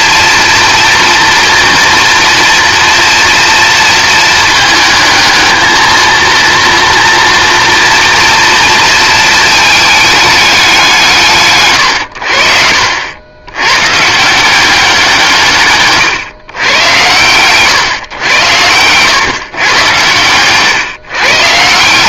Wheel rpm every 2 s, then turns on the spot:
230, 230, 220, 230, 230, 180, 80, 180, 110, 120, 130.
none